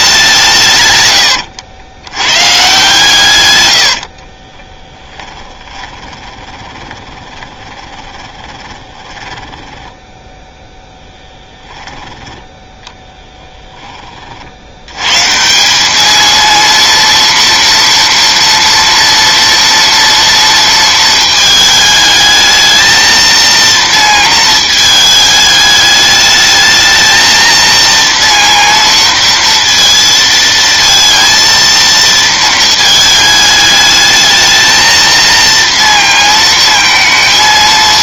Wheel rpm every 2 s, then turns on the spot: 140, 140, 20, 20, 20, 10, 10, 80, 230, 230, 230, 220, 220, 220, 230, 230, 220, 220, 230.
4-10